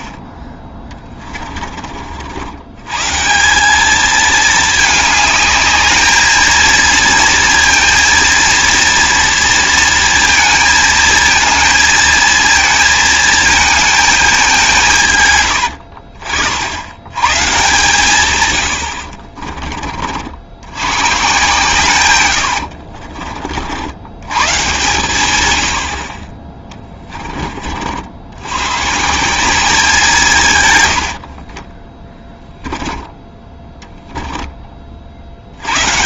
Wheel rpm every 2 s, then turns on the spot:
20, 110, 220, 220, 230, 220, 230, 180, 70, 90, 90, 70, 130, 20, 120, 120, 10, 20.
22-24 26-28 32-34